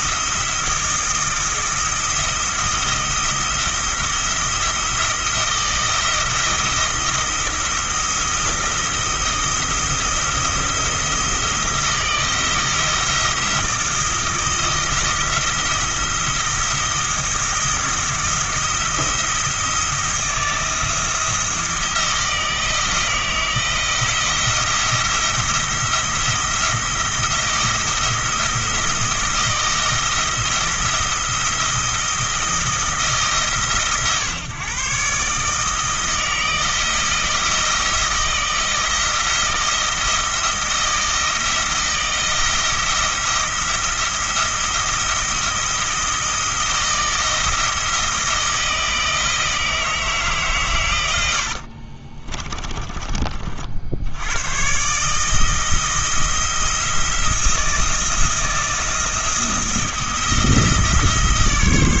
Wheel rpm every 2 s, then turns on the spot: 170, 170, 170, 170, 170, 170, 170, 170, 170, 170, 170, 160, 170, 170, 170, 170, 160, 140, 170, 160, 170, 170, 170, 170, 160, 100, 30, 130, 170, 170, 160.
52-54